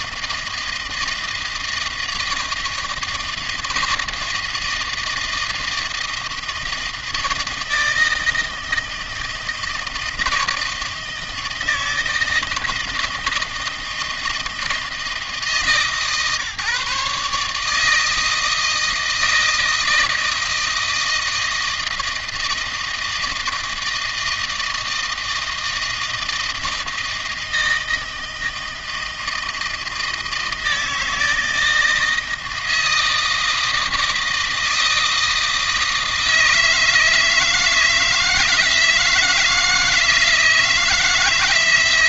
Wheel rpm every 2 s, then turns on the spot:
160, 160, 160, 160, 160, 160, 160, 160, 150, 160, 160, 160, 160, 160, 160, 160, 160, 160, 160, 160, 160.
none